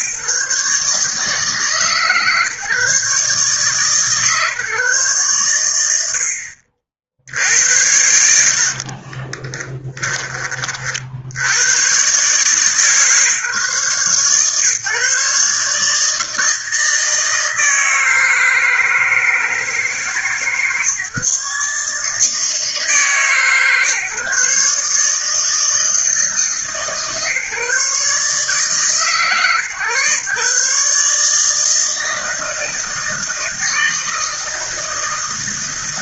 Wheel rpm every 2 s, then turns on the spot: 140, 140, 130, 70, 50, 50, 140, 130, 160, 160, 140, 150, 150, 140, 140, 150, 160, 160.
8-10